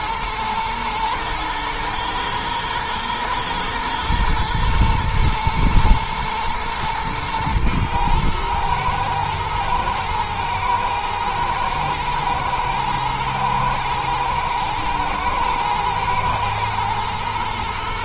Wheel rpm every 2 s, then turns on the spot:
120, 120, 120, 110, 120, 110, 110, 120, 120.
none